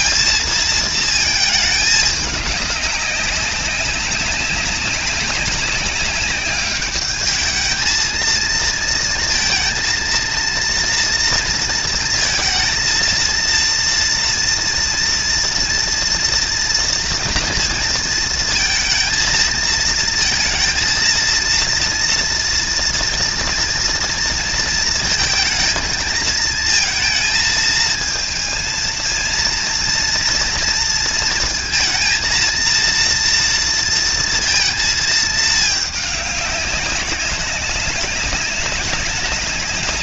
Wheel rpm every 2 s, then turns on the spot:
230, 200, 200, 200, 230, 230, 230, 230, 230, 230, 230, 230, 220, 220, 220, 230, 230, 230, 200, 190.
none